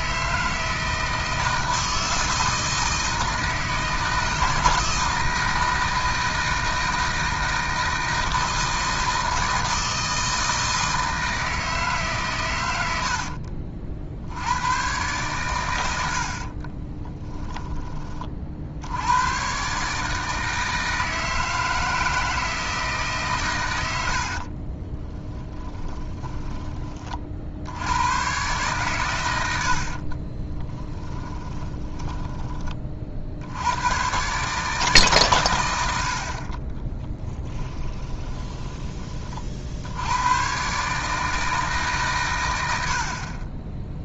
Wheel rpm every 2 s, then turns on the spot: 160, 160, 160, 160, 160, 160, 110, 110, 30, 80, 160, 160, 20, 20, 120, 20, 40, 140, 20, 20, 150, 70.
16-18 24-26 30-32 36-38